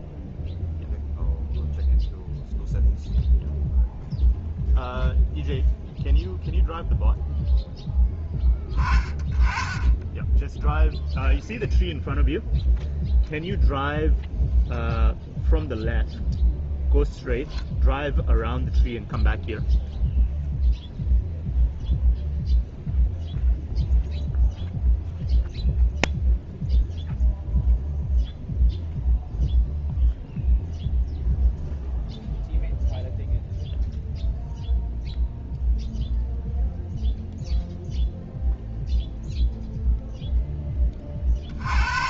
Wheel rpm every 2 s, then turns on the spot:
0, 0, 0, 0, 10, 0, 0, 0, 0, 0, 0, 0, 0, 0, 0, 0, 0, 0, 0, 0, 10.
none